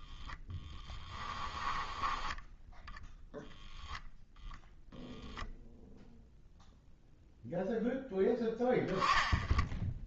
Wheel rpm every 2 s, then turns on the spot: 20, 10, 0, 0, 20.
0-4